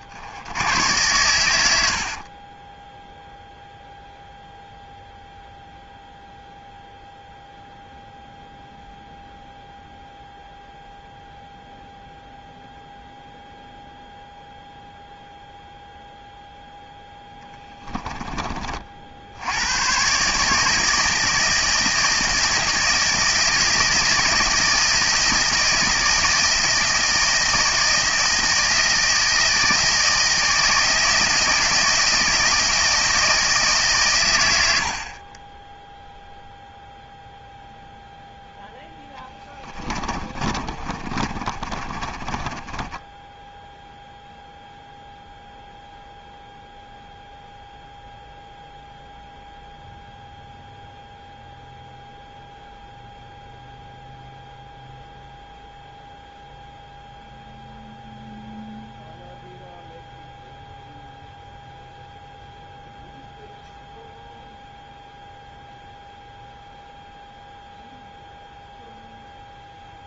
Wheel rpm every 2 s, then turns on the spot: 90, 30, 0, 0, 0, 0, 0, 0, 0, 30, 150, 160, 160, 160, 160, 160, 160, 100, 0, 0, 30, 20, 0, 0, 0, 0, 0, 0, 0, 0, 0, 0, 0, 0, 0.
2-4 40-44